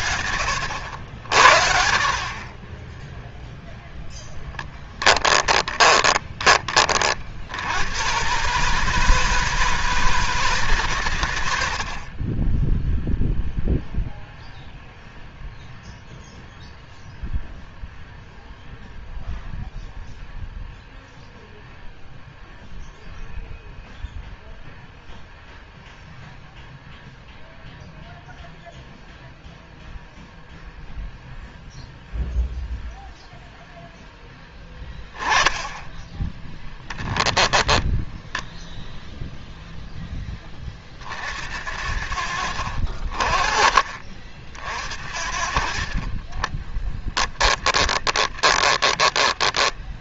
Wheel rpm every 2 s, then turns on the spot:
80, 20, 10, 50, 160, 150, 10, 0, 0, 0, 0, 0, 0, 0, 0, 0, 0, 10, 10, 0, 50, 50, 70, 10, 20.
4-6 46-50